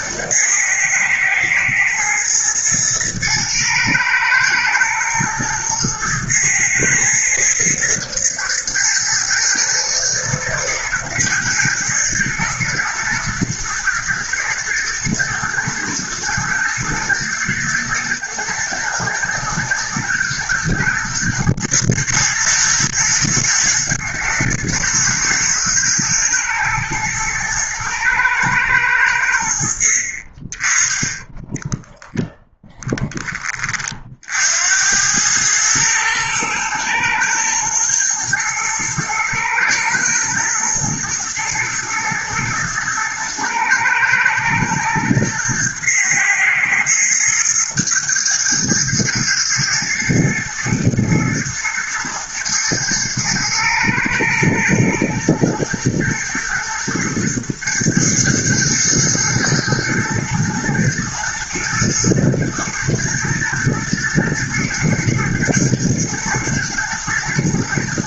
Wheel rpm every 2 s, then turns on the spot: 110, 120, 110, 110, 120, 120, 110, 110, 110, 120, 110, 120, 110, 120, 100, 20, 10, 80, 110, 110, 110, 120, 120, 110, 110, 110, 110, 120, 110, 110, 110, 120, 110, 110.
none